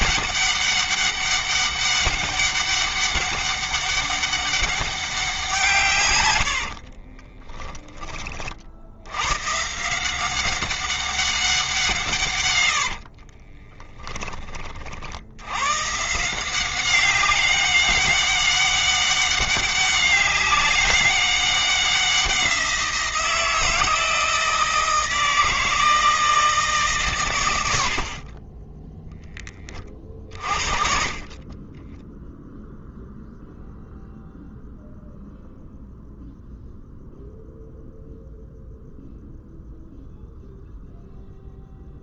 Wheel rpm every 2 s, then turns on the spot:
200, 200, 190, 50, 70, 190, 70, 60, 190, 200, 190, 170, 160, 140, 10, 30, 0, 0, 0, 0, 0.
6-8 12-14